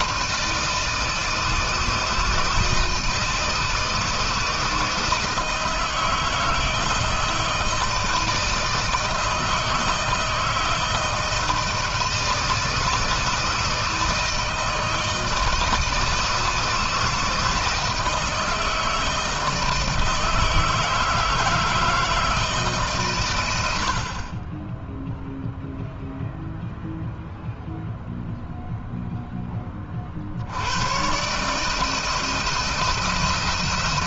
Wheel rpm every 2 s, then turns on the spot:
160, 160, 160, 160, 160, 160, 160, 160, 160, 160, 160, 130, 0, 0, 0, 130, 160.
none